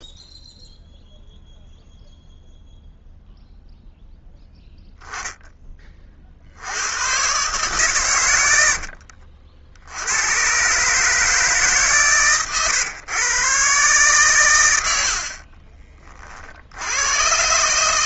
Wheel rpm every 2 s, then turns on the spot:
0, 0, 0, 50, 100, 110, 130, 120, 50.
none